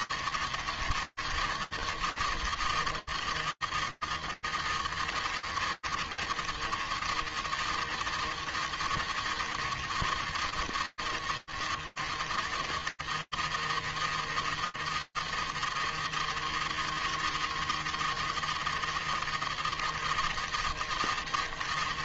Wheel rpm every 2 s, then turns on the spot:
170, 160, 170, 160, 170, 170, 170, 170, 160, 170, 170.
none